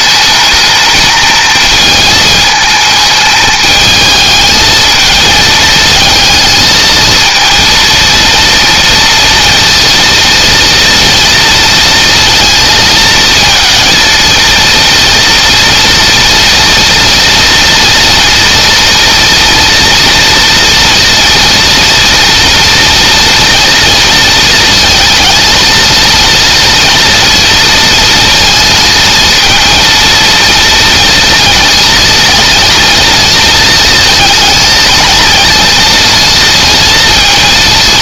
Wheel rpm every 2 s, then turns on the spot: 220, 210, 220, 230, 230, 230, 230, 230, 230, 240, 230, 230, 230, 230, 230, 230, 230, 230, 230.
none